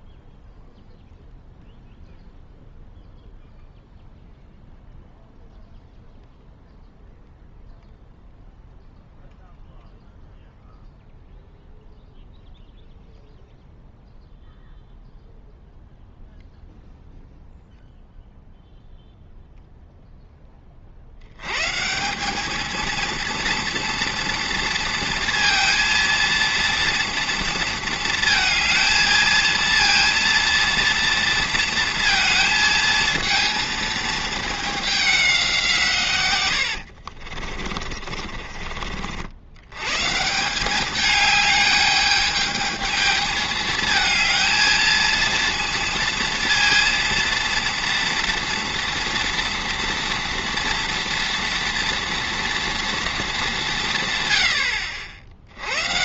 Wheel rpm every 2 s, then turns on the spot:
0, 0, 0, 0, 0, 0, 0, 0, 0, 0, 10, 210, 230, 230, 230, 230, 230, 210, 90, 30, 180, 210, 220, 230, 230, 230, 240, 110.
36-40